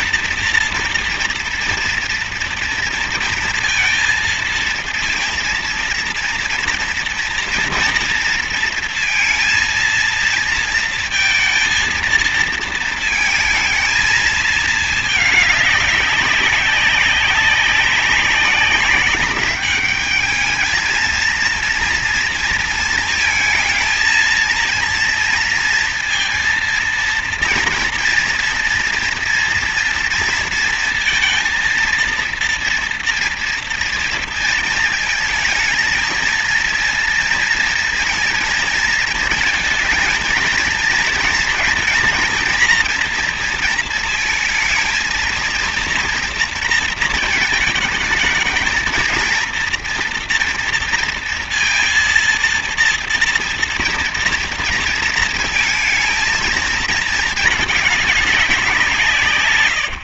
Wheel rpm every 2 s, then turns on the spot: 230, 230, 230, 230, 230, 230, 230, 220, 190, 200, 220, 230, 230, 230, 230, 230, 230, 230, 230, 230, 220, 230, 230, 230, 220, 230, 230, 230, 220, 190.
none